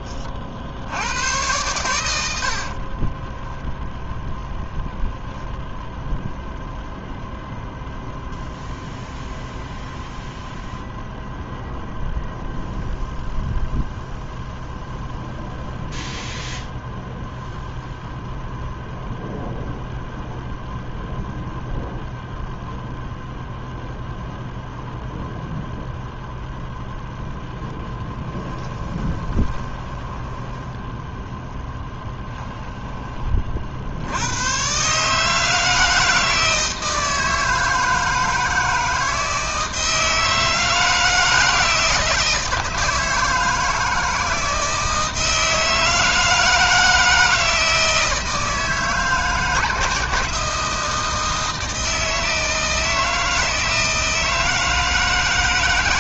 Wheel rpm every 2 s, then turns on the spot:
70, 50, 0, 0, 0, 0, 0, 0, 0, 0, 0, 0, 0, 10, 20, 10, 10, 130, 160, 160, 160, 160, 160, 160, 160, 160, 160, 160.
2-4 28-34